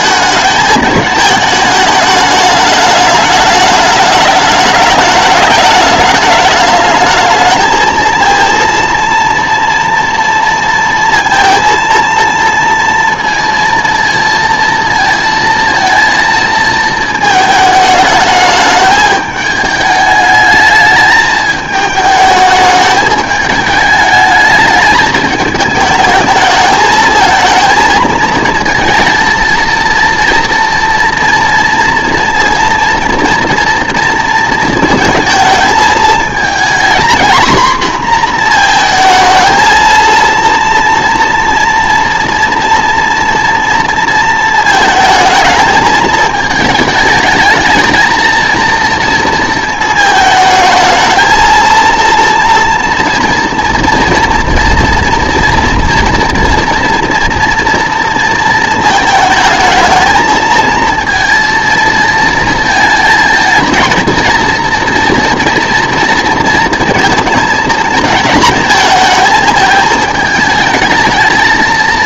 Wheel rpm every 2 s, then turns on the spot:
220, 210, 210, 220, 230, 230, 230, 230, 220, 210, 220, 210, 210, 220, 230, 230, 230, 220, 240, 230, 240, 230, 220, 210, 230, 220, 230, 230, 230, 220, 230, 220, 230, 230, 220, 220.
none